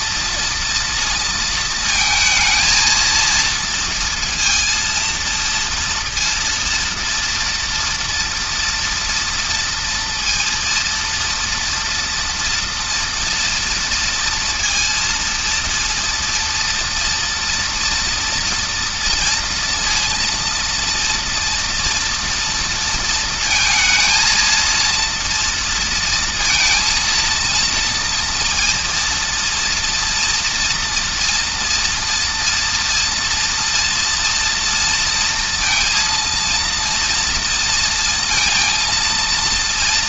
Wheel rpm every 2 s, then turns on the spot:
230, 230, 230, 230, 230, 230, 240, 230, 240, 230, 230, 230, 230, 230, 230, 230, 230, 230, 230, 230.
none